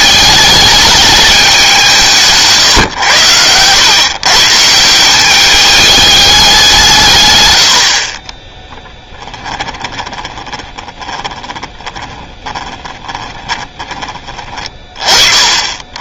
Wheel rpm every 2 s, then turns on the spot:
210, 120, 160, 160, 10, 20, 10, 40.
8-14